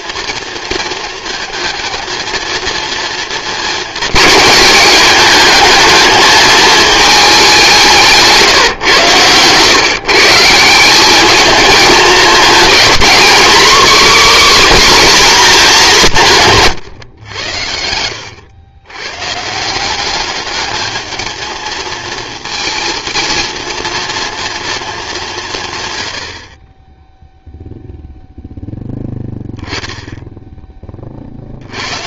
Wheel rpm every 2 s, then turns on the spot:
230, 230, 220, 220, 150, 170, 220, 280, 150, 100, 210, 230, 230, 30, 10, 20.
none